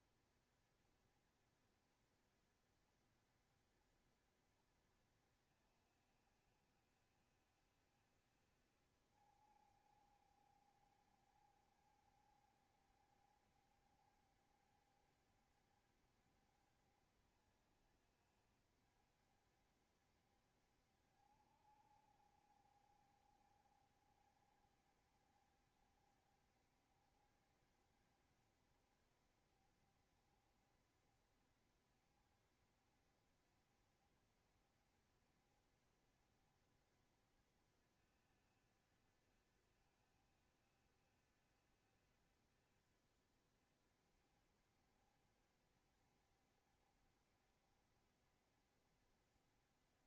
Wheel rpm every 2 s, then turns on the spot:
70, 70, 60, 70, 70, 70, 60, 70, 60, 70, 60, 70, 70, 70, 60, 70, 60, 70, 70, 70, 70, 70, 70, 70, 70.
none